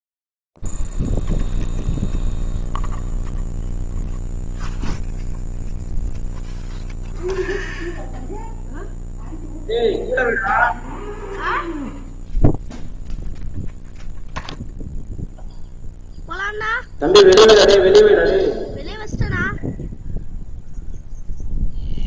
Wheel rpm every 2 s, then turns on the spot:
0, 0, 0, 0, 0, 0, 0, 0, 0, 0, 0.
none